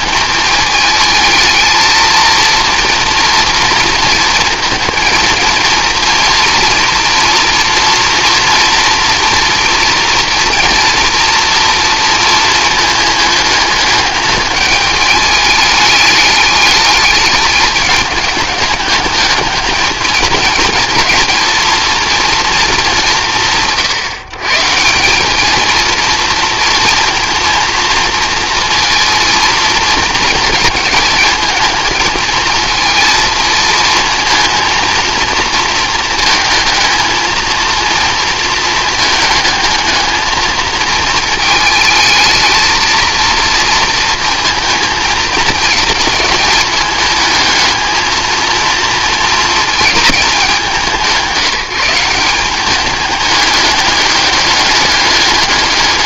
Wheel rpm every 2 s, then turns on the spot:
210, 230, 230, 230, 230, 230, 220, 210, 210, 210, 220, 210, 160, 230, 230, 220, 230, 230, 220, 220, 220, 220, 230, 220, 230, 190, 200, 210.
none